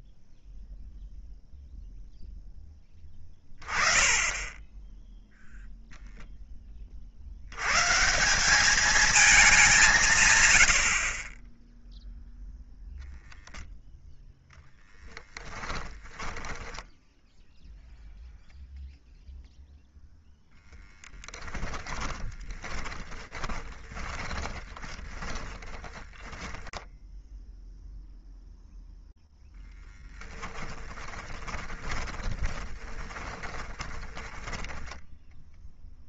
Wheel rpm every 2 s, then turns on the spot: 0, 10, 10, 30, 210, 60, 0, 10, 10, 0, 10, 30, 20, 10, 0, 10, 20, 10.
16-18 20-26 30-36